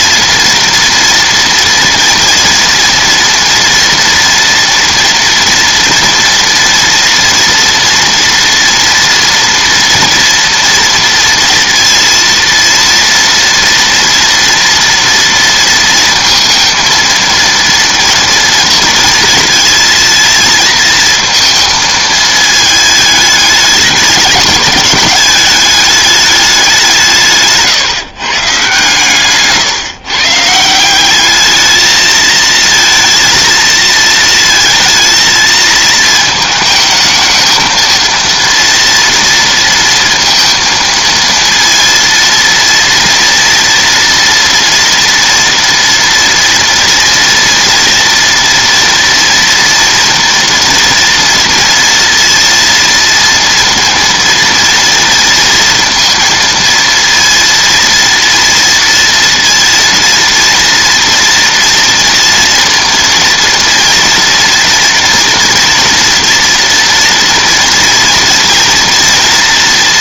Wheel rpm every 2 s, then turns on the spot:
230, 230, 230, 240, 230, 230, 230, 230, 230, 230, 230, 220, 210, 180, 150, 170, 230, 220, 220, 230, 230, 230, 230, 230, 230, 230, 230, 230, 230, 230, 230, 230, 230, 230, 230.
none